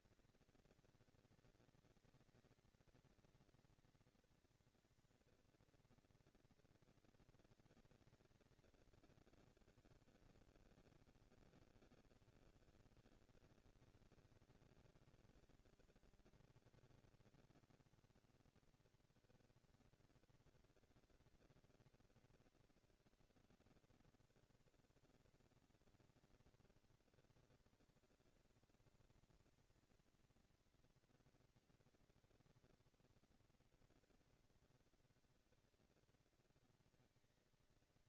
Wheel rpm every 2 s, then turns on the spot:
230, 230, 230, 230, 220, 150, 130, 200, 230, 230, 240, 230, 230, 230, 230, 230, 230, 230, 220.
none